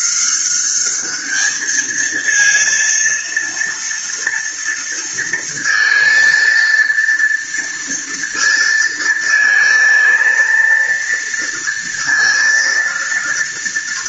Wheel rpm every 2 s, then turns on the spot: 200, 230, 230, 230, 230, 230, 230.
none